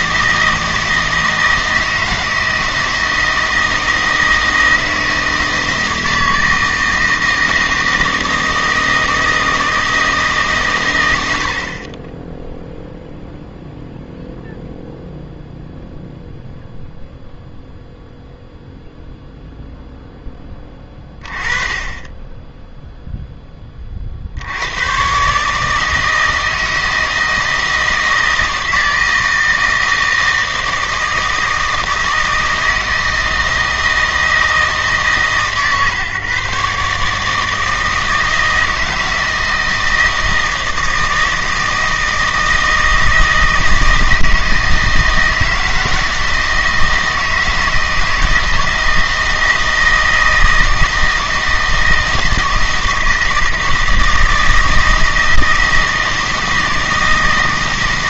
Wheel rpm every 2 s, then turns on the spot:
160, 160, 160, 160, 160, 130, 0, 0, 0, 0, 20, 10, 90, 160, 160, 160, 160, 150, 140, 160, 160, 160, 160, 160, 160, 160, 160, 160, 160.
none